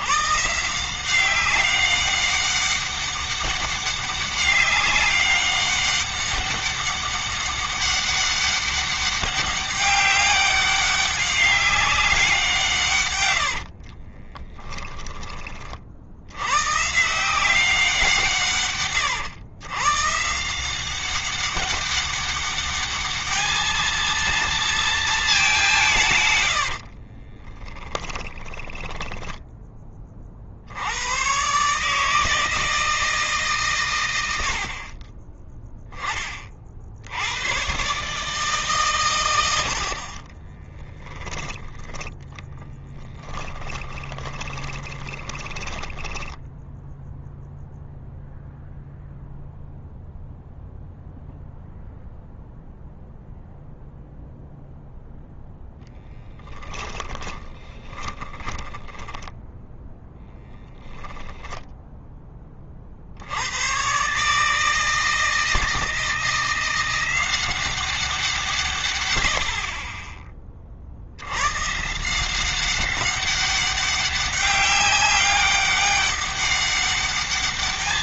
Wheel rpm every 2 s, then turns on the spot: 160, 200, 200, 200, 200, 200, 170, 20, 120, 160, 180, 200, 230, 90, 10, 90, 160, 60, 50, 140, 20, 30, 20, 10, 0, 0, 0, 0, 10, 10, 10, 30, 150, 180, 130, 40, 190, 200, 200.
14-16 26-30 40-48 56-62